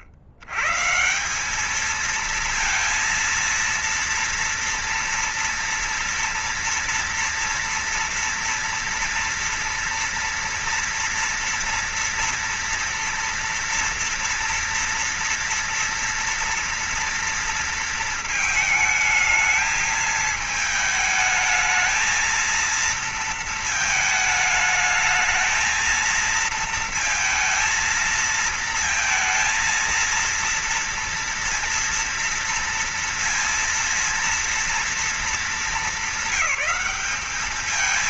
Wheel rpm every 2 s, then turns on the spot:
100, 220, 240, 240, 240, 230, 230, 230, 230, 220, 220, 220, 220, 220, 220, 230, 230, 230, 190.
none